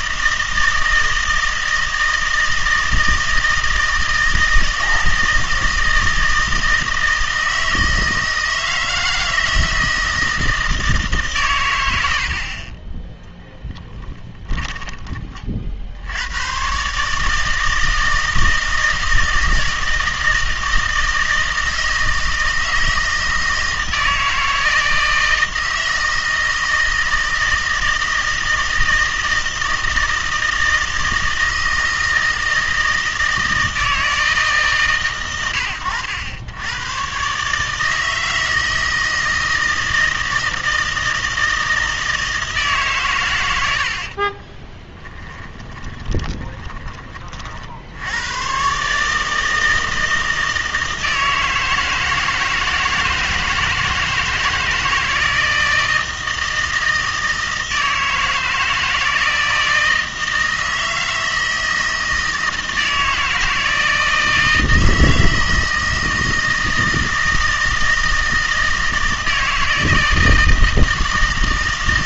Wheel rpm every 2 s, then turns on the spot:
160, 160, 160, 160, 160, 160, 30, 20, 130, 160, 160, 160, 160, 160, 160, 160, 160, 140, 100, 160, 160, 150, 20, 20, 130, 160, 160, 160, 160, 160, 160, 160, 160, 160, 160, 160.
44-46